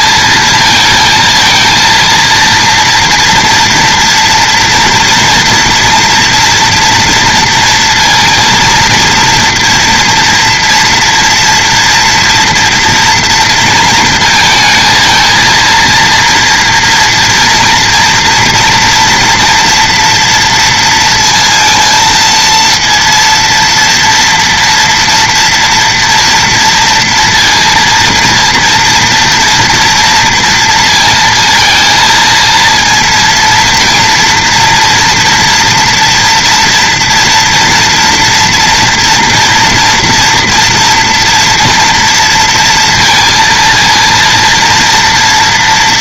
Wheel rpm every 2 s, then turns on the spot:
230, 230, 240, 230, 230, 230, 230, 220, 230, 230, 230, 230, 230, 230, 230, 230, 220, 230, 230, 230, 230, 230, 230.
none